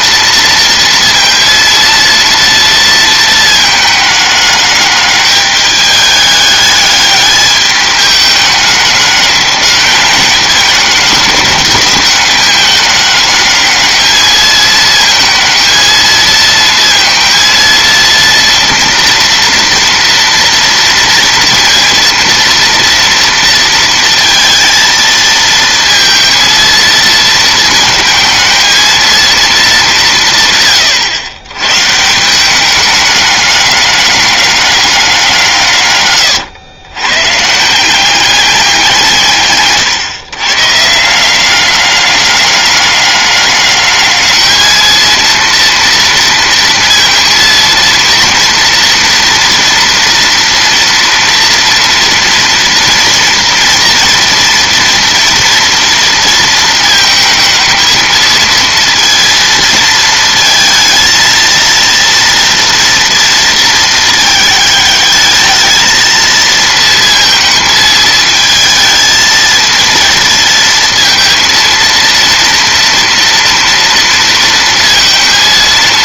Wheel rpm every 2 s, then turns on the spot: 230, 230, 210, 210, 210, 210, 210, 220, 230, 230, 230, 230, 230, 230, 220, 130, 200, 200, 110, 190, 150, 200, 220, 230, 240, 230, 230, 230, 230, 230, 230, 230, 220, 230, 220, 230, 230, 230.
none